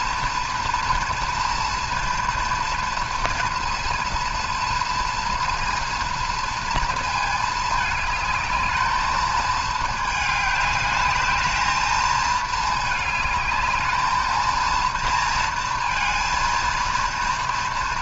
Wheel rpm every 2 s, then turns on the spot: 230, 230, 230, 230, 210, 210, 210, 230, 230.
none